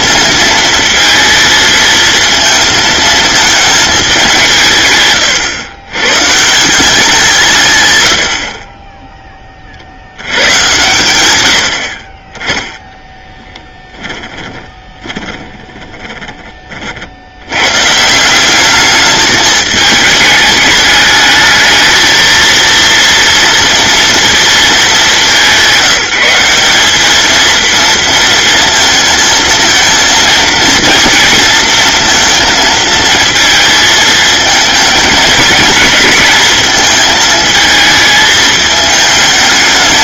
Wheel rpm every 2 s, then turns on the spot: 230, 220, 130, 180, 20, 100, 10, 20, 70, 210, 210, 230, 210, 210, 230, 230, 220, 220, 220, 220.
12-16